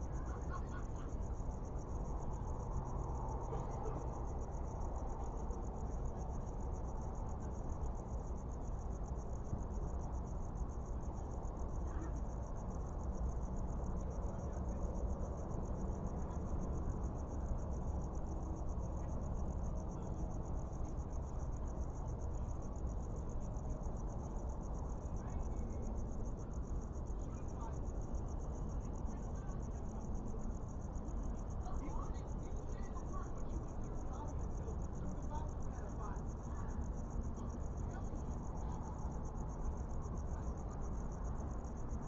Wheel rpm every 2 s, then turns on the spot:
0, 0, 0, 0, 0, 0, 0, 0, 0, 0, 0, 0, 0, 0, 0, 0, 0, 0, 0, 0, 0.
none